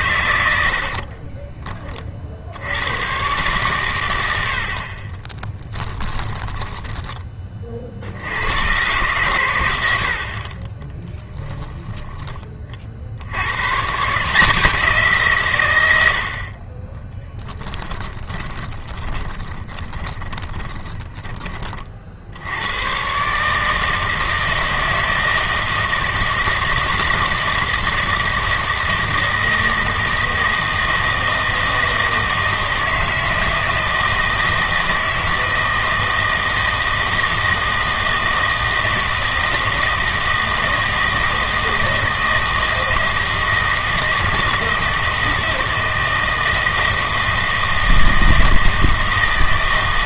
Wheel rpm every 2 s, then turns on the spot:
70, 80, 60, 10, 110, 30, 40, 170, 20, 10, 10, 100, 160, 160, 160, 160, 160, 160, 160, 160, 160, 160, 160, 160, 160.
0-2 4-8 18-22